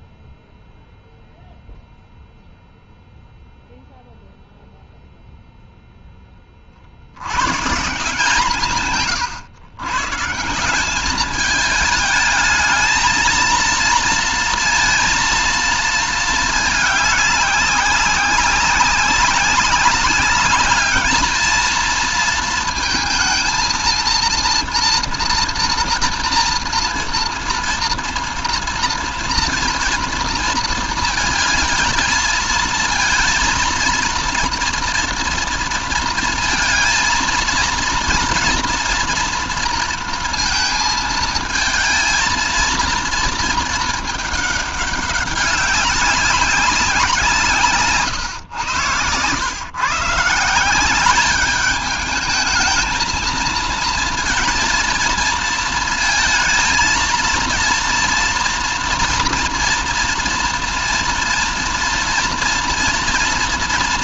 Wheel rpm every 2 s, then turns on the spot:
0, 0, 0, 60, 140, 190, 220, 230, 210, 190, 210, 220, 230, 230, 230, 230, 220, 240, 220, 230, 220, 230, 200, 180, 110, 190, 220, 230, 230, 240, 230, 230.
none